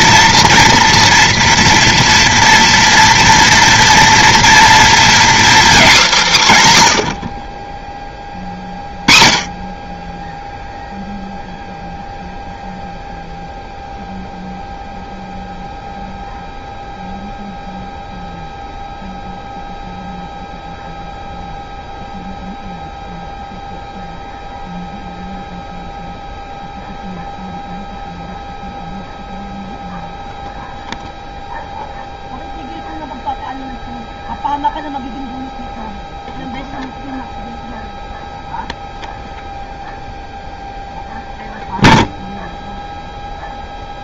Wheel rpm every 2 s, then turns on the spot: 230, 230, 230, 180, 20, 0, 0, 0, 0, 0, 0, 0, 0, 0, 0, 0, 0, 0, 0, 0, 0, 0.
none